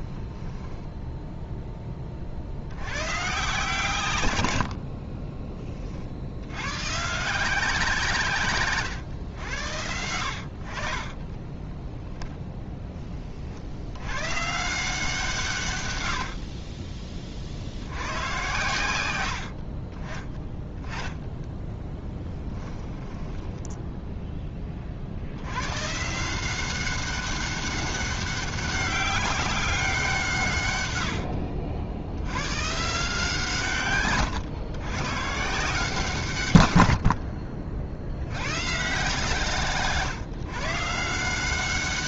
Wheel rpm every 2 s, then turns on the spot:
20, 100, 70, 110, 120, 50, 30, 160, 30, 100, 20, 10, 30, 190, 200, 120, 140, 120, 80, 140, 140.
0-2 4-6 20-24